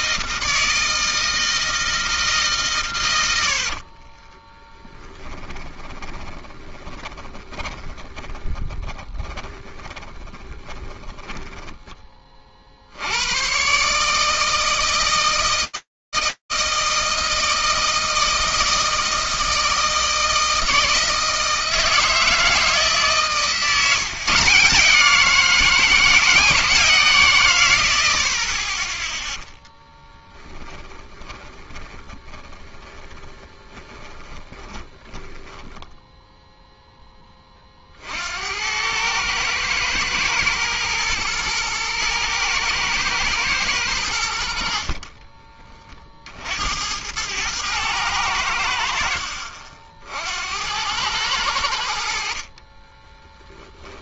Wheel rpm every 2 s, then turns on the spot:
160, 140, 20, 20, 20, 10, 40, 160, 160, 160, 160, 150, 170, 160, 10, 20, 20, 10, 20, 110, 110, 120, 30, 100, 60, 100, 10.
4-12 30-36 44-46 52-54